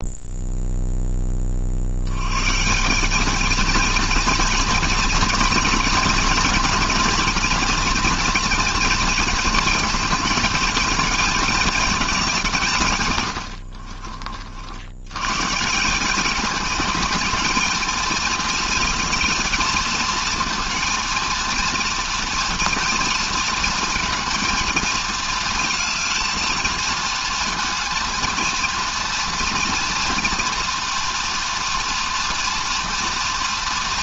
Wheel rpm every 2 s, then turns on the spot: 10, 190, 220, 240, 230, 220, 120, 100, 210, 220, 230, 230, 230, 230, 230, 230, 240.
none